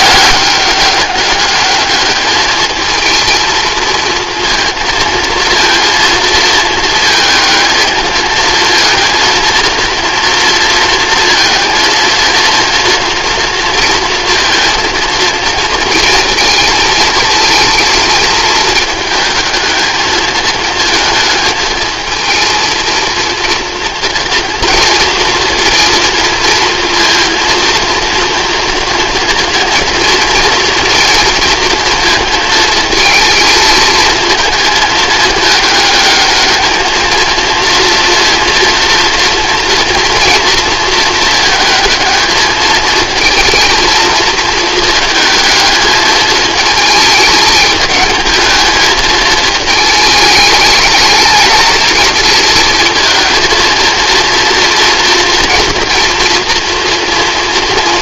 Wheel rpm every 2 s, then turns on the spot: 200, 210, 230, 220, 220, 230, 230, 230, 230, 220, 220, 230, 230, 230, 230, 230, 220, 220, 210, 230, 230, 220, 220, 220, 210, 210, 220, 230, 230.
none